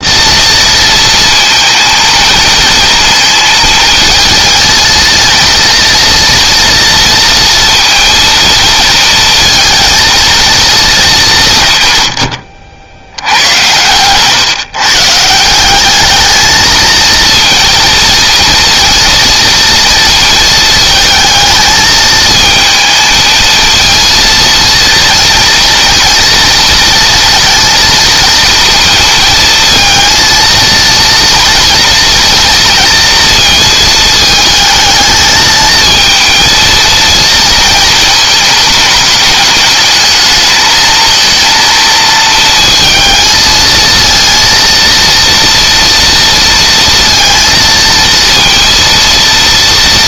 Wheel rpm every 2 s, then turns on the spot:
230, 230, 230, 230, 230, 190, 80, 160, 230, 230, 220, 220, 230, 230, 220, 230, 230, 220, 230, 210, 220, 220, 230, 230, 230.
none